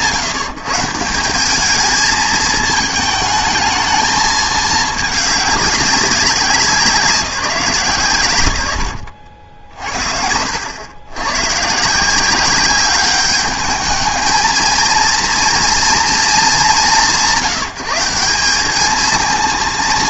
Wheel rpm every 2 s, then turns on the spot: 160, 220, 220, 180, 80, 90, 200, 230, 190, 210.
none